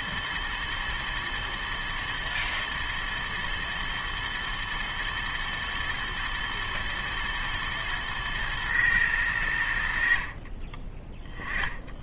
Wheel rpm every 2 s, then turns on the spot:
120, 110, 110, 110, 110, 30.
10-12